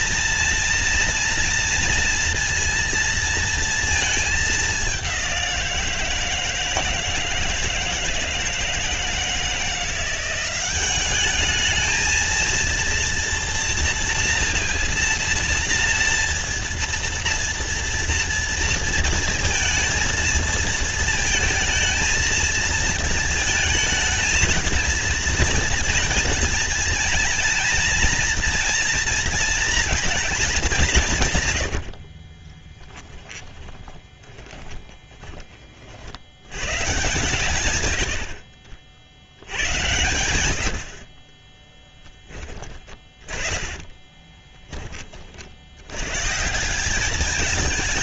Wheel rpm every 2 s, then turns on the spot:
230, 230, 210, 160, 160, 180, 220, 230, 230, 230, 230, 230, 220, 230, 230, 200, 30, 20, 110, 70, 90, 20, 20, 150.
32-36